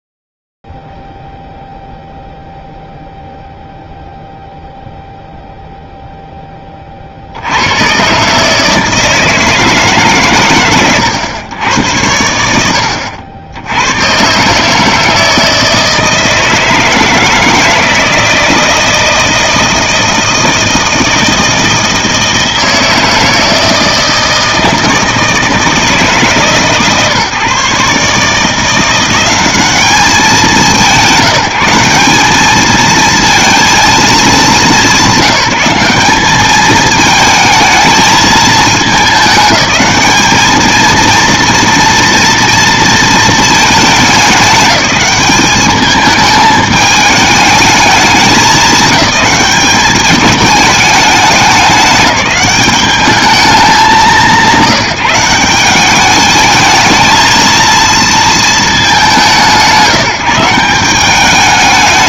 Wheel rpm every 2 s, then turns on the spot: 0, 0, 0, 0, 130, 140, 100, 140, 160, 160, 160, 160, 160, 150, 160, 200, 200, 200, 210, 220, 220, 230, 190, 220, 210, 210, 200, 150, 210, 210, 170.
none